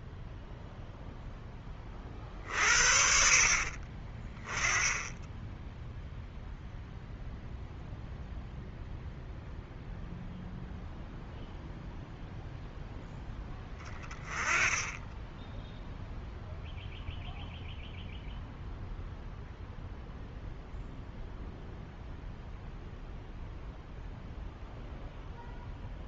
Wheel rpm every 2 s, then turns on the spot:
0, 50, 10, 0, 0, 0, 0, 10, 0, 0, 0, 0, 0.
none